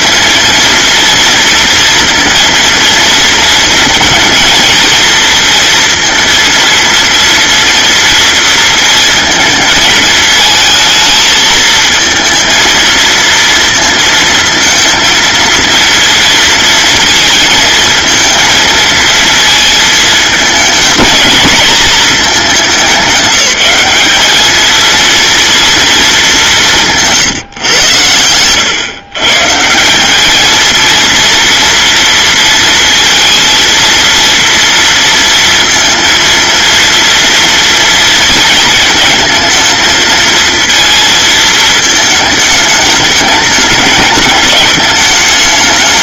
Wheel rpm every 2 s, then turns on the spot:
240, 230, 230, 230, 230, 220, 220, 230, 230, 220, 220, 210, 220, 180, 110, 220, 230, 230, 230, 230, 230, 210, 210.
none